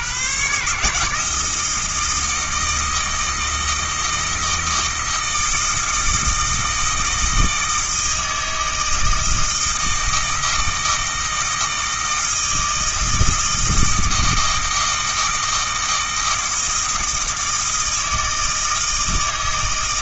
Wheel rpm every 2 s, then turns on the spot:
140, 160, 160, 160, 160, 160, 160, 160, 160, 160.
none